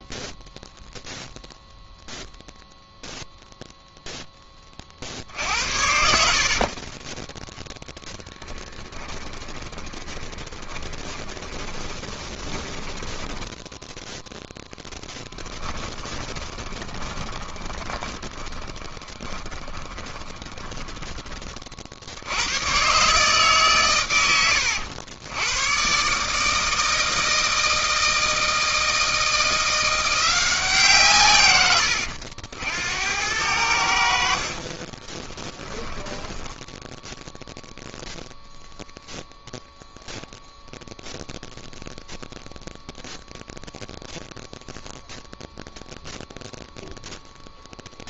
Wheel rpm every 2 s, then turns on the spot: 0, 0, 20, 40, 10, 20, 20, 0, 20, 20, 20, 100, 100, 160, 160, 170, 80, 40, 10, 0, 0, 0, 0, 0.
6-14 16-22 34-36